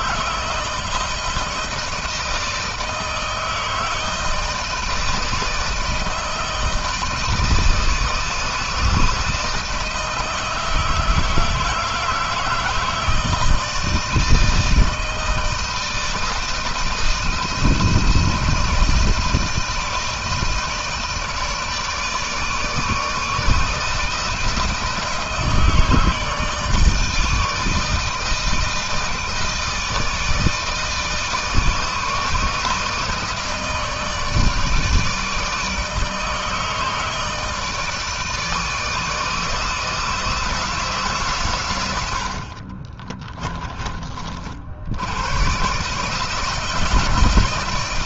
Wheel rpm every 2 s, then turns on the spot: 160, 160, 160, 160, 160, 160, 160, 160, 170, 160, 160, 160, 160, 160, 160, 160, 150, 160, 160, 160, 150, 40, 70, 150.
42-44